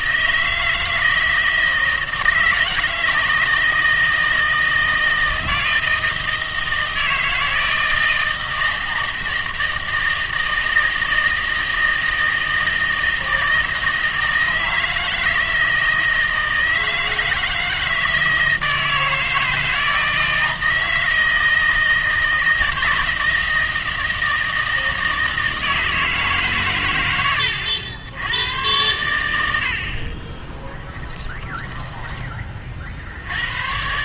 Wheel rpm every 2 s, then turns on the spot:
160, 160, 160, 160, 160, 160, 160, 160, 160, 160, 160, 160, 160, 130, 90, 20, 40.
30-32